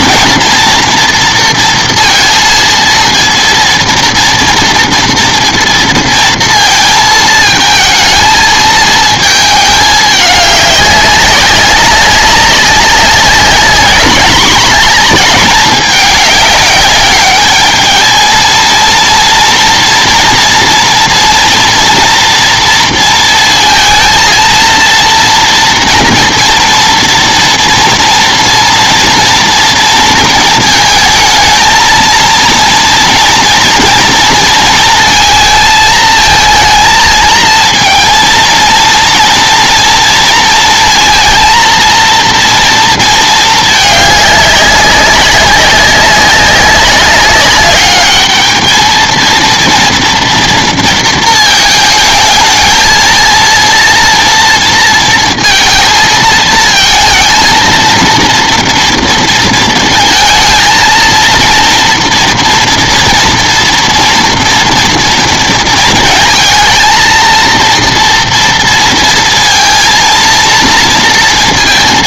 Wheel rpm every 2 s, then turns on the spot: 230, 230, 230, 230, 220, 200, 200, 220, 200, 220, 230, 230, 230, 230, 230, 220, 230, 230, 220, 230, 230, 230, 200, 190, 220, 230, 220, 230, 220, 230, 220, 230, 230, 220, 230, 230.
none